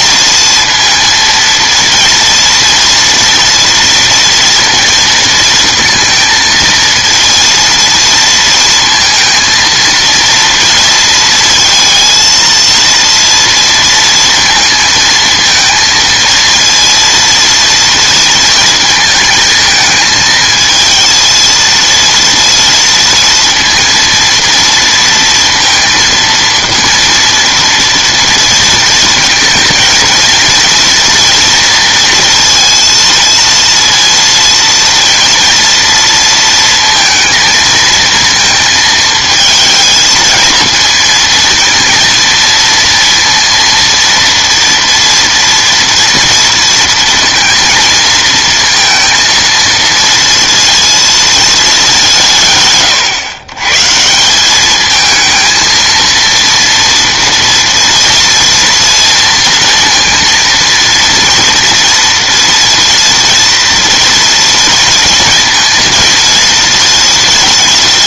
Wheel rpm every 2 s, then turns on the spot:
230, 230, 230, 230, 230, 230, 230, 230, 230, 220, 230, 230, 230, 230, 230, 230, 230, 230, 230, 220, 230, 230, 230, 230, 230, 230, 130, 220, 230, 230, 230, 230, 230, 230.
none